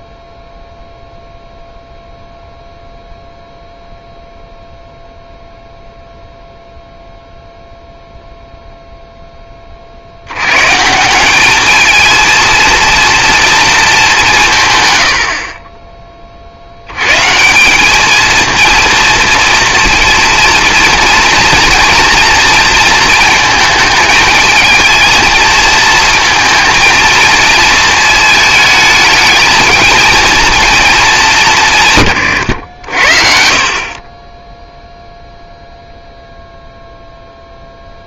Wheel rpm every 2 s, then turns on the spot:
0, 0, 0, 0, 0, 140, 230, 130, 70, 230, 230, 230, 220, 220, 220, 220, 80, 0, 0.
none